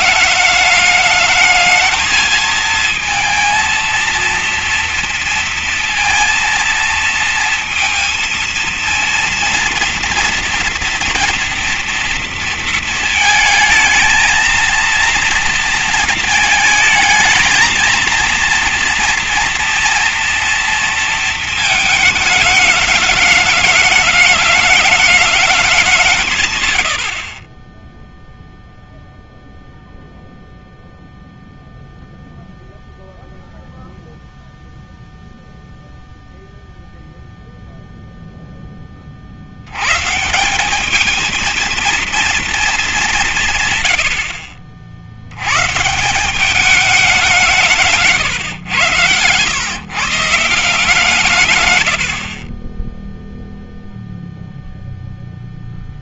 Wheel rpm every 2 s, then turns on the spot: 210, 220, 230, 230, 230, 230, 230, 220, 220, 230, 230, 210, 220, 130, 0, 0, 0, 0, 0, 10, 170, 220, 60, 190, 110, 160, 30, 0.
none